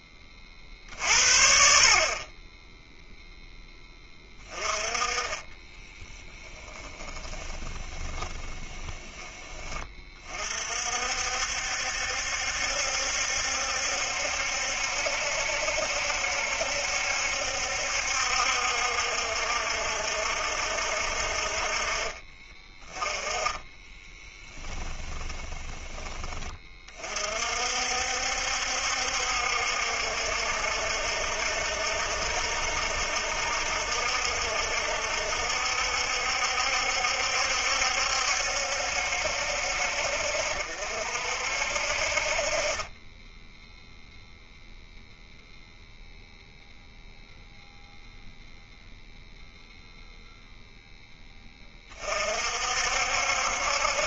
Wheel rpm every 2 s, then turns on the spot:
50, 0, 20, 20, 20, 50, 70, 70, 70, 60, 60, 20, 20, 30, 70, 70, 70, 70, 70, 70, 60, 30, 0, 0, 0, 0, 60.
4-10 24-26